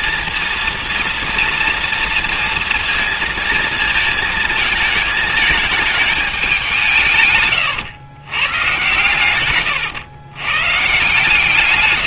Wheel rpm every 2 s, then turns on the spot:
230, 230, 220, 190, 120, 120.
none